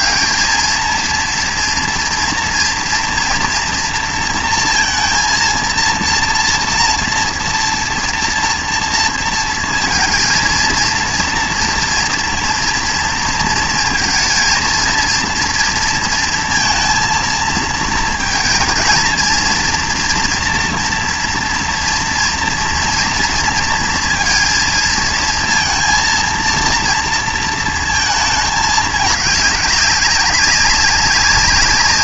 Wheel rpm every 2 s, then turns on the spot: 220, 230, 230, 230, 230, 230, 230, 230, 230, 230, 240, 230, 230, 230, 210, 200.
none